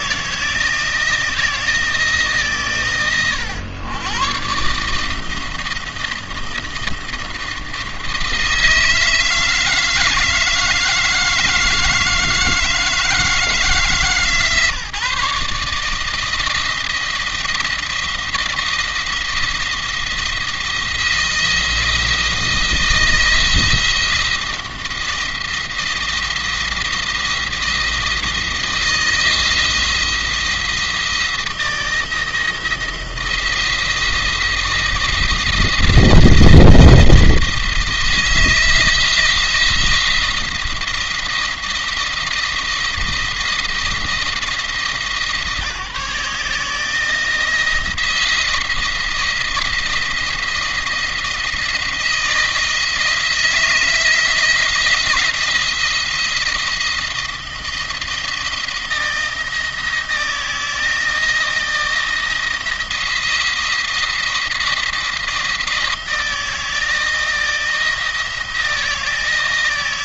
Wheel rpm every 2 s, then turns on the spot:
160, 120, 130, 170, 160, 160, 160, 150, 160, 170, 170, 170, 170, 170, 170, 170, 170, 170, 170, 170, 170, 170, 170, 160, 170, 170, 160, 170, 160, 160, 160, 170, 170, 160, 160.
none